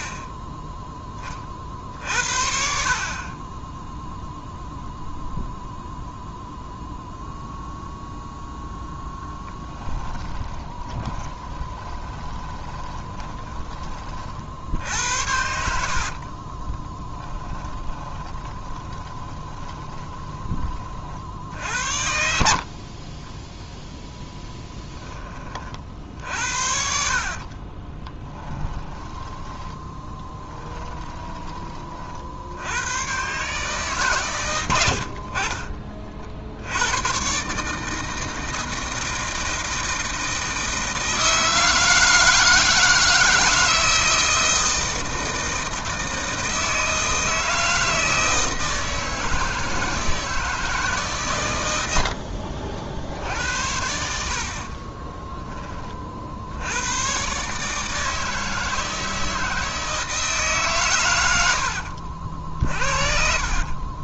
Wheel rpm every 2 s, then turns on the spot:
10, 70, 0, 0, 0, 20, 20, 70, 10, 20, 40, 40, 10, 60, 10, 20, 110, 80, 100, 160, 160, 160, 160, 160, 160, 150, 60, 30, 100, 160, 120, 40.
10-20 22-24 26-32 34-36 54-56 62-64